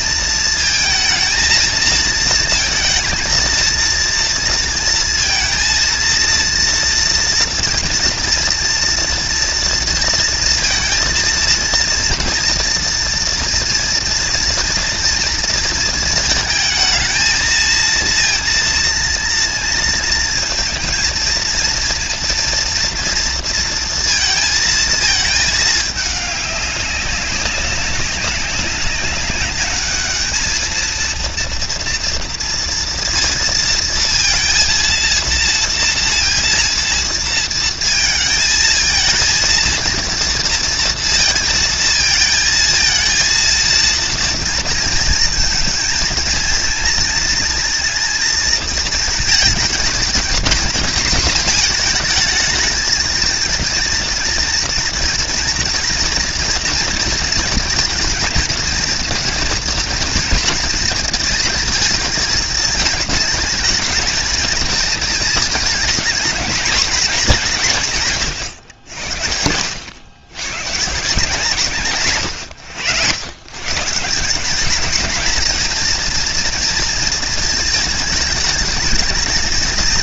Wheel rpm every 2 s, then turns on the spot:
220, 230, 230, 230, 230, 230, 230, 230, 220, 230, 230, 240, 220, 200, 200, 220, 230, 230, 230, 230, 230, 220, 230, 230, 230, 230, 230, 230, 230, 230, 230, 220, 220, 220, 90, 120, 100, 200, 230, 220.
none